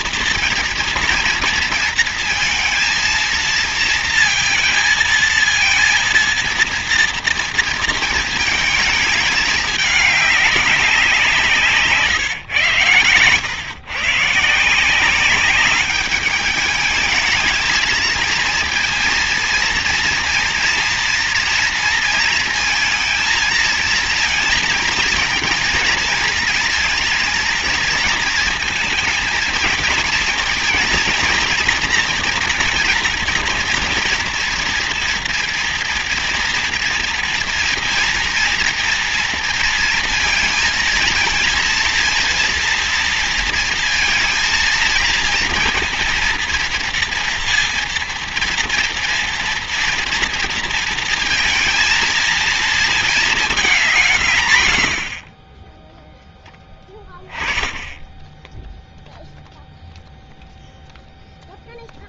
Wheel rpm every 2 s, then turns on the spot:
230, 230, 230, 230, 220, 200, 130, 170, 210, 230, 230, 230, 230, 230, 220, 230, 230, 230, 230, 240, 230, 230, 230, 230, 230, 230, 220, 100, 10, 0, 0.
none